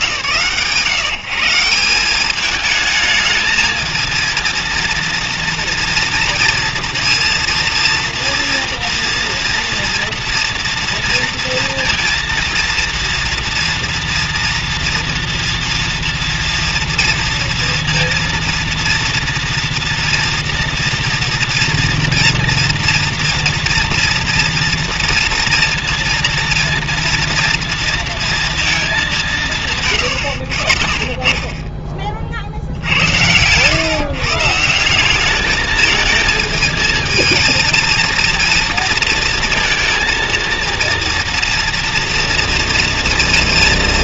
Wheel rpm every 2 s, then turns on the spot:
100, 200, 230, 230, 230, 230, 230, 240, 230, 230, 240, 240, 230, 230, 230, 70, 60, 150, 220, 230, 230, 230.
30-32